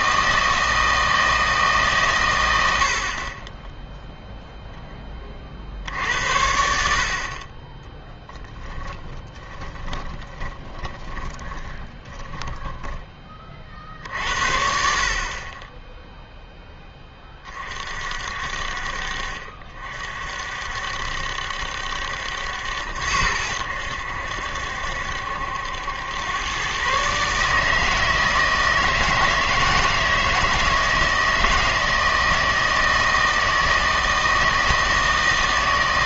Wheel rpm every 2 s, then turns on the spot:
160, 90, 0, 70, 20, 20, 10, 60, 10, 50, 60, 80, 70, 130, 160, 160, 160, 160.
8-14